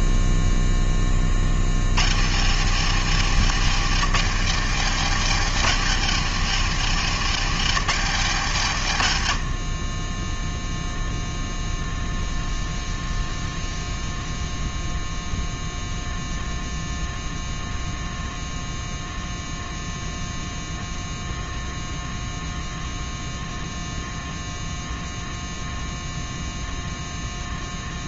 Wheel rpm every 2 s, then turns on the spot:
0, 150, 200, 210, 170, 0, 0, 0, 0, 0, 0, 0, 0, 0.
none